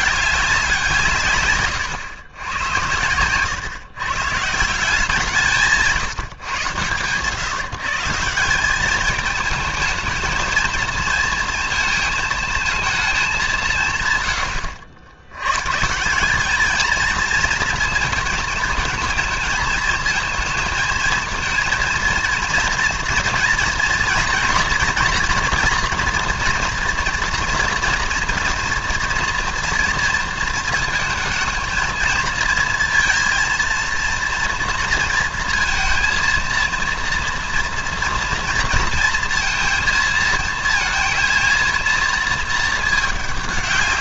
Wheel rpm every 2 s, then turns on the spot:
190, 110, 160, 120, 190, 220, 220, 100, 210, 220, 220, 230, 230, 230, 230, 230, 230, 230, 230, 230, 230, 220.
none